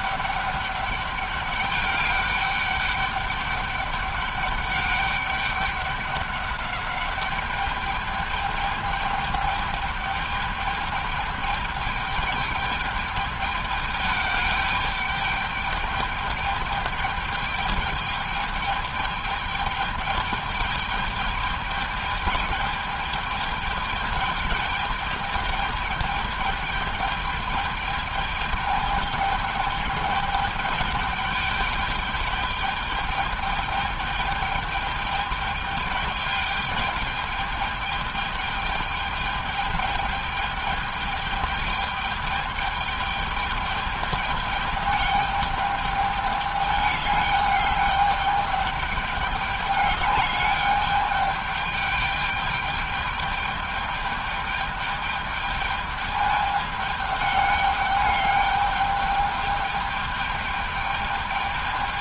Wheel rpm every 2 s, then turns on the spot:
200, 200, 200, 200, 210, 210, 210, 210, 210, 210, 210, 210, 210, 210, 210, 210, 210, 210, 210, 210, 210, 210, 210, 200, 210, 210, 210, 210, 210, 210, 210.
none